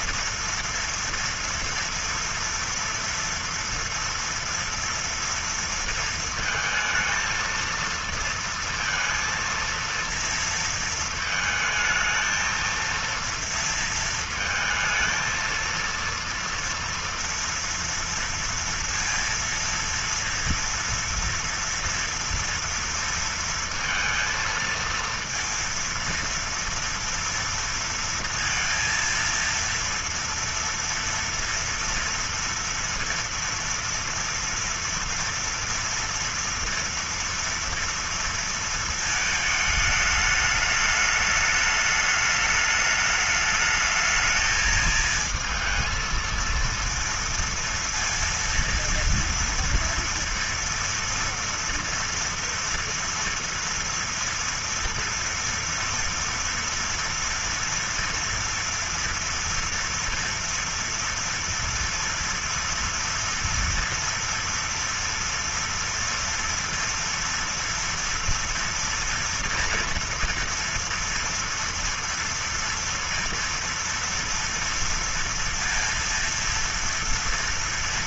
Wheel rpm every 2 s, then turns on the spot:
230, 230, 240, 220, 230, 230, 230, 230, 230, 230, 230, 230, 230, 230, 230, 230, 240, 230, 230, 230, 210, 210, 220, 230, 230, 230, 230, 230, 230, 230, 230, 230, 230, 230, 230, 230, 230, 230, 230.
none